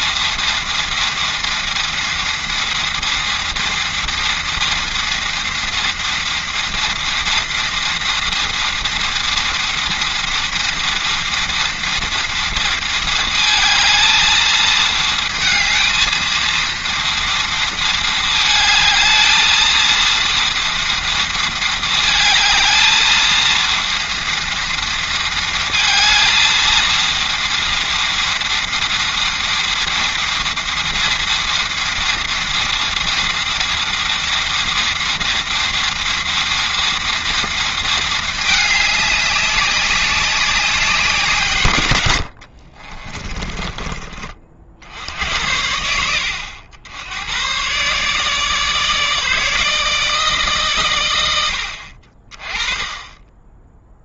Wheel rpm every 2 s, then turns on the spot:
230, 230, 230, 230, 230, 230, 220, 220, 230, 220, 230, 230, 230, 230, 230, 230, 230, 230, 230, 200, 170, 30, 70, 100, 150, 110, 20.
42-44